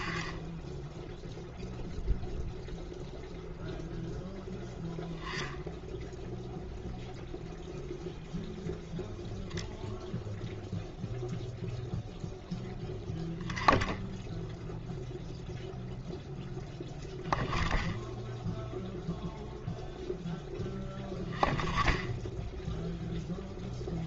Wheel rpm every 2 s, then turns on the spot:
0, 0, 0, 0, 0, 0, 0, 0, 0, 0, 0, 0.
none